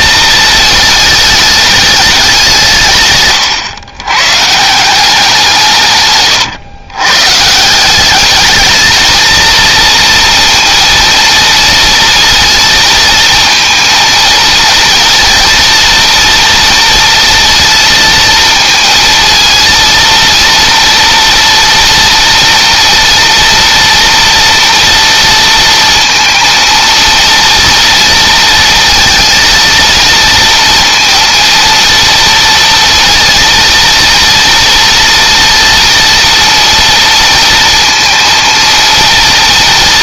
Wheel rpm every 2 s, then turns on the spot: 220, 140, 180, 130, 230, 230, 230, 230, 230, 230, 230, 230, 230, 230, 230, 230, 230, 230, 230, 230.
none